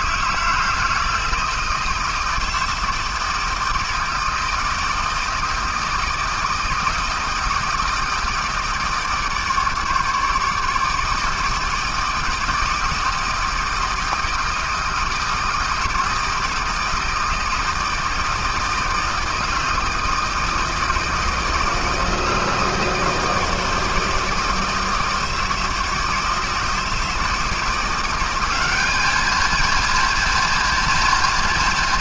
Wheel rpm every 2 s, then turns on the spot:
160, 160, 160, 160, 150, 160, 160, 160, 160, 160, 160, 160, 160, 160, 200, 230.
none